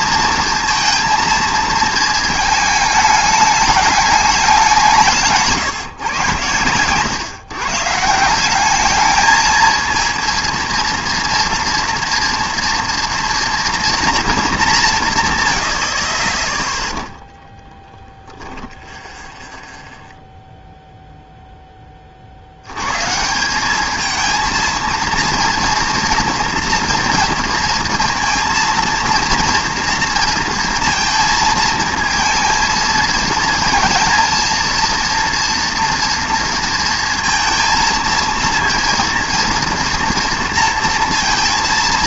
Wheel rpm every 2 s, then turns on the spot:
230, 220, 200, 110, 190, 230, 230, 200, 10, 0, 0, 90, 230, 230, 230, 230, 230, 230, 230, 230, 230.
none